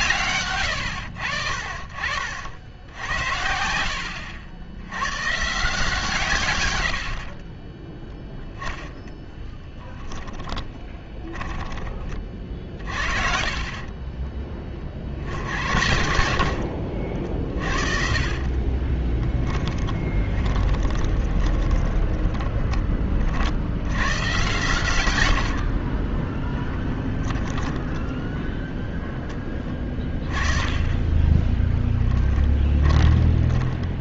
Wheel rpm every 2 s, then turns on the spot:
100, 90, 90, 90, 0, 10, 40, 50, 50, 20, 20, 30, 110, 20, 10, 20, 20.
2-4 10-14 16-22 26-28 30-34